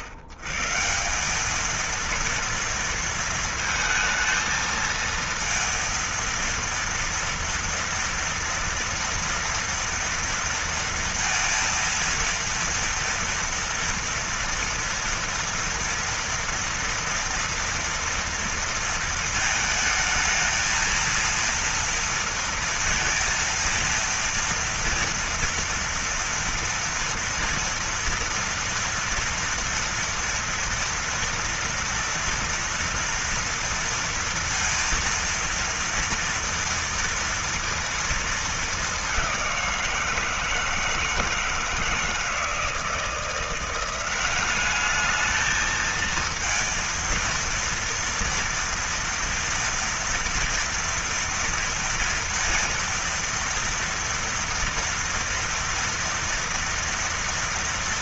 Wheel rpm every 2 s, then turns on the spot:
110, 230, 220, 230, 230, 230, 230, 240, 230, 230, 220, 230, 230, 240, 230, 230, 230, 230, 230, 220, 170, 160, 200, 230, 230, 230, 230, 230, 230.
none